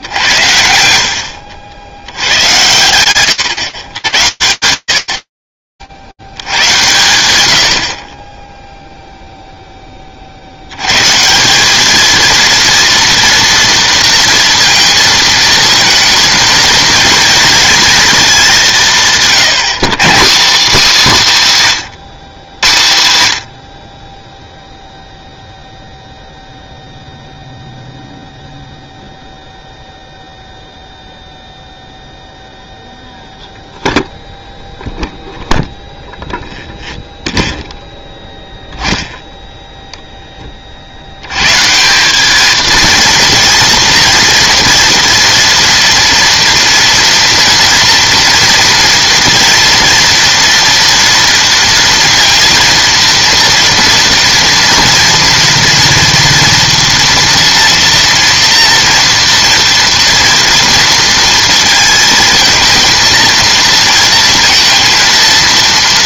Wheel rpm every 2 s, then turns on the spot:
70, 110, 110, 70, 30, 60, 230, 230, 230, 190, 250, 130, 0, 0, 0, 0, 0, 0, 0, 0, 140, 230, 230, 230, 240, 230, 230, 230, 230, 230, 230, 230, 230.
none